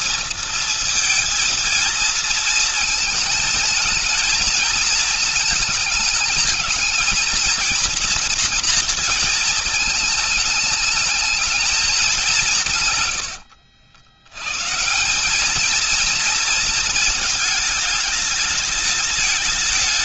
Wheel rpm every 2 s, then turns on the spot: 230, 230, 220, 220, 230, 220, 190, 120, 230, 210.
none